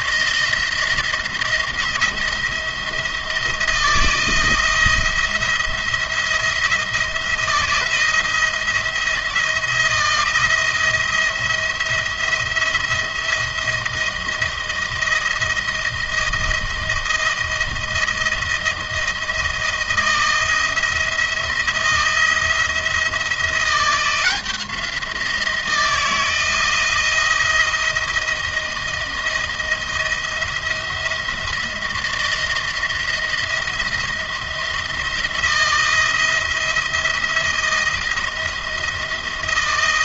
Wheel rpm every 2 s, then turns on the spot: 170, 170, 170, 170, 170, 170, 170, 160, 160, 160, 160, 170, 170, 160, 160, 170, 170, 170, 170, 170.
none